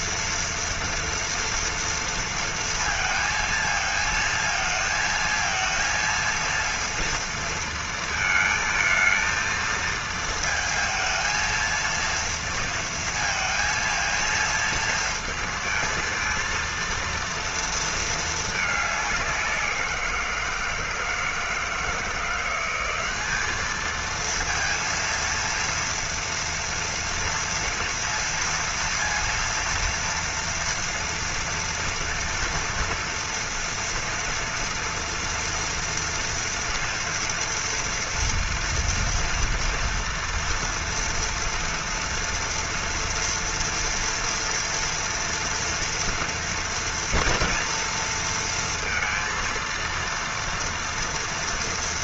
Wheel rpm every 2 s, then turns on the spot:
230, 230, 220, 230, 220, 220, 230, 230, 230, 210, 170, 180, 230, 230, 230, 230, 230, 230, 230, 230, 230, 240, 230, 240, 230, 230.
none